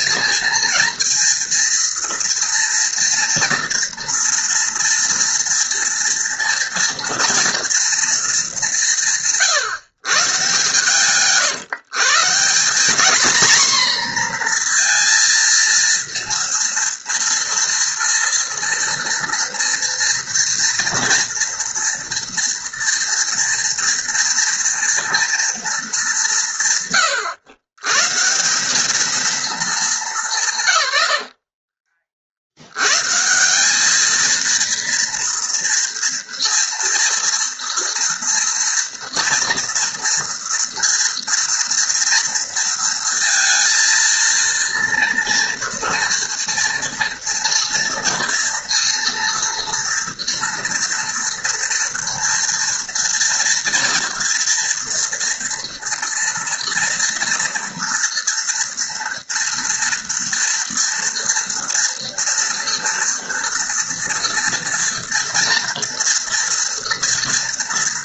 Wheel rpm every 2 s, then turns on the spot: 230, 240, 230, 230, 190, 140, 210, 230, 230, 230, 240, 230, 230, 140, 200, 130, 110, 230, 230, 240, 230, 230, 230, 230, 230, 230, 230, 230, 230, 240, 230, 230, 230, 230.
none